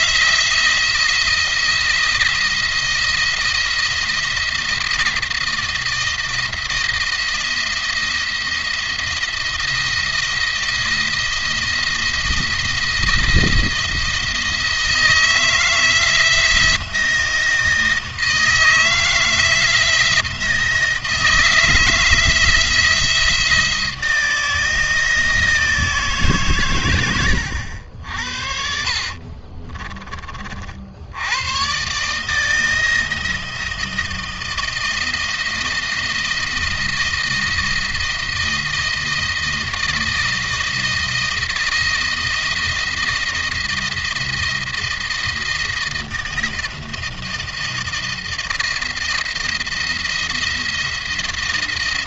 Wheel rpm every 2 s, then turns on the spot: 170, 170, 170, 170, 170, 170, 170, 160, 170, 160, 170, 170, 160, 120, 60, 60, 160, 160, 170, 160, 160, 160, 170, 170, 170, 170.
26-30